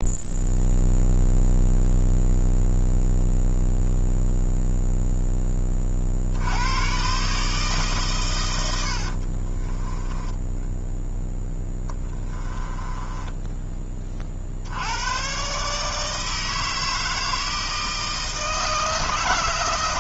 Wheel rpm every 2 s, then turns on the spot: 0, 0, 0, 100, 90, 10, 20, 80, 160, 160.
8-10 12-14